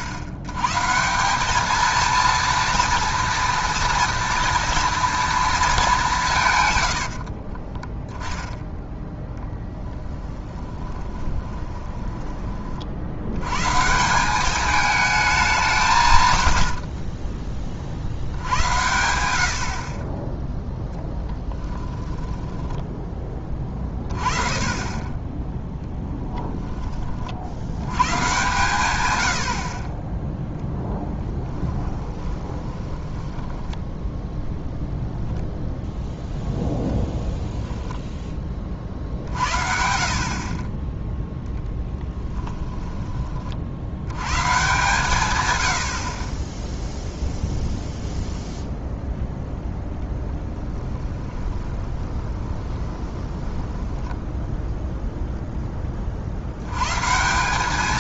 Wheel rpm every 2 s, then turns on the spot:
100, 230, 230, 120, 0, 20, 40, 210, 90, 90, 0, 10, 40, 10, 120, 0, 20, 0, 10, 40, 20, 10, 140, 10, 0, 10, 20, 0, 100.
10-12 16-18 22-24 32-34 42-44 50-54